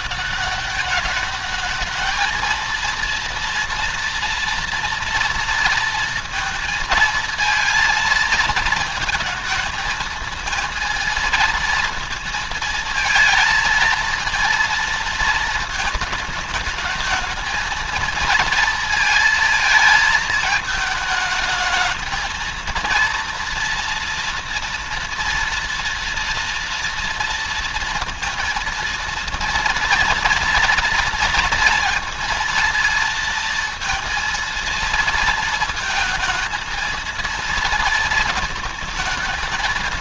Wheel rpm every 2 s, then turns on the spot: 200, 230, 230, 220, 220, 230, 220, 230, 220, 230, 220, 230, 230, 230, 230, 230, 230, 230, 230, 220.
none